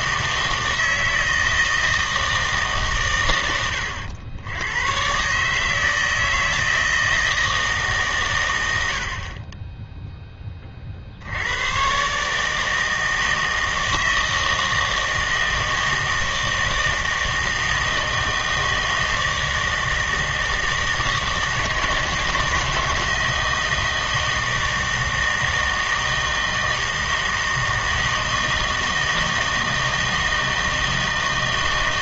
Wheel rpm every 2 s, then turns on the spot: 160, 130, 110, 160, 90, 30, 160, 160, 160, 160, 160, 160, 160, 160, 160, 160.
none